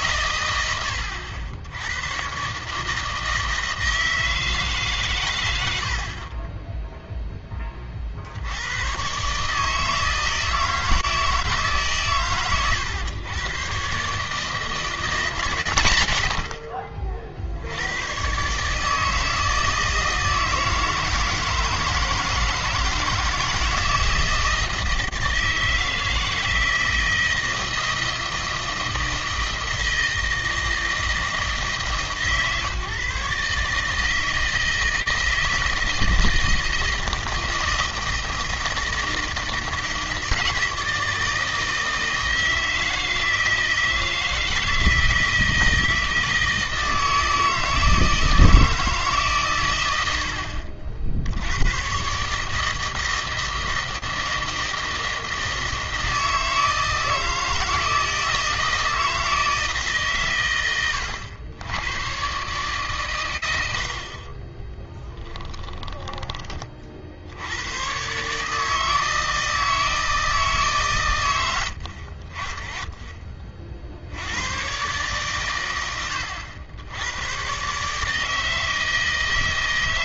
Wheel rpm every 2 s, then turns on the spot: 100, 150, 140, 10, 100, 160, 120, 160, 50, 150, 160, 160, 160, 160, 160, 160, 140, 160, 160, 160, 160, 160, 160, 160, 160, 80, 160, 160, 160, 160, 100, 140, 20, 30, 160, 140, 20, 130, 90, 160.
64-66